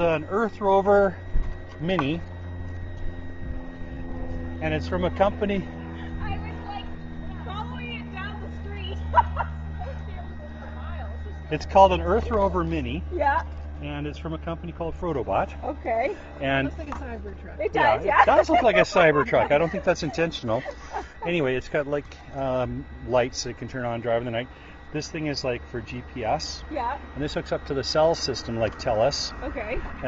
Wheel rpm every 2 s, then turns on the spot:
0, 0, 0, 0, 0, 0, 0, 0, 0, 0, 0, 0, 0, 0, 0.
none